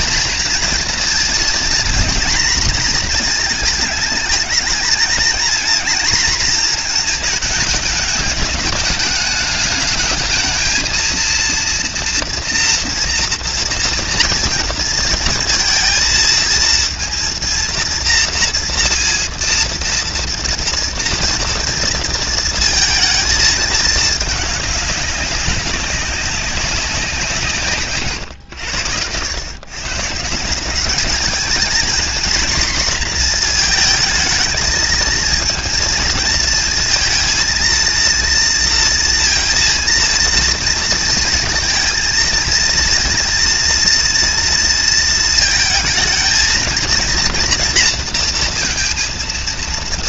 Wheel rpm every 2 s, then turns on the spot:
230, 240, 220, 230, 210, 220, 230, 230, 230, 230, 230, 230, 210, 190, 110, 180, 240, 220, 230, 230, 230, 230, 230, 230, 230.
none